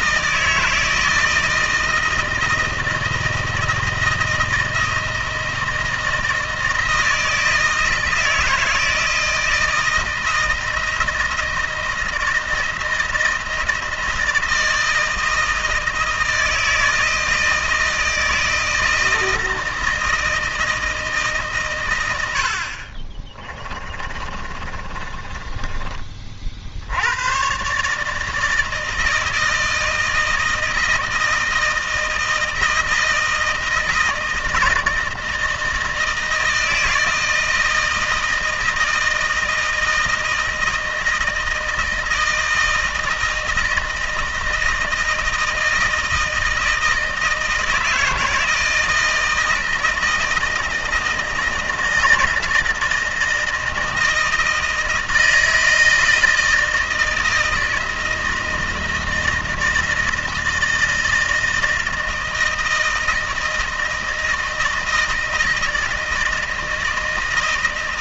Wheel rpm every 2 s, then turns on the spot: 160, 160, 160, 160, 160, 160, 170, 160, 160, 160, 160, 80, 30, 50, 160, 160, 160, 160, 160, 160, 160, 160, 160, 160, 160, 160, 160, 160, 160, 160, 160, 160, 160, 160.
24-26